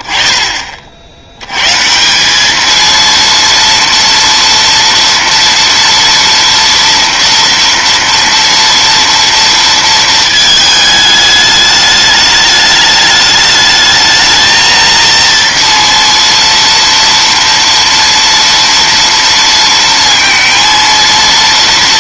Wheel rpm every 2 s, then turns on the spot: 10, 210, 230, 230, 230, 220, 210, 220, 230, 230, 230.
none